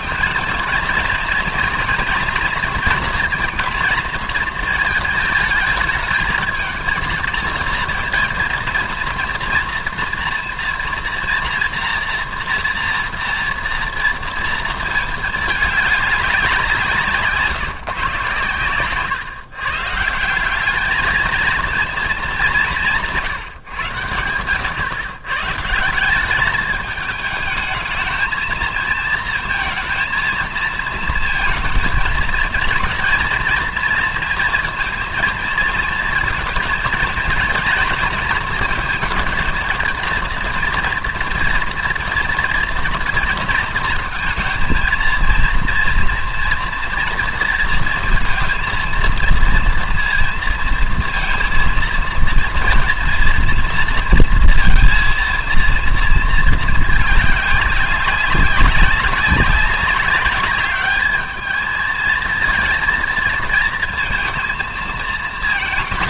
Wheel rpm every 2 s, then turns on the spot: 230, 230, 230, 220, 230, 240, 240, 230, 180, 120, 190, 210, 100, 210, 220, 220, 230, 230, 230, 230, 230, 230, 230, 230, 230, 230, 230, 230, 220, 190, 200, 230, 230.
none